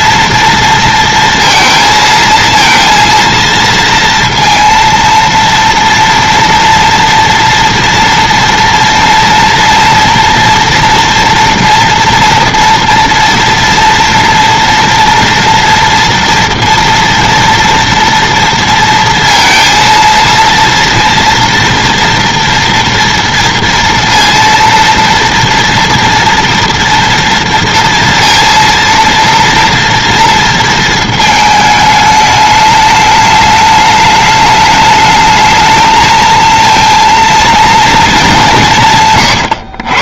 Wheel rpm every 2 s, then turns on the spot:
230, 230, 230, 230, 230, 230, 230, 230, 230, 230, 230, 230, 230, 230, 230, 230, 210, 210, 230, 160.
none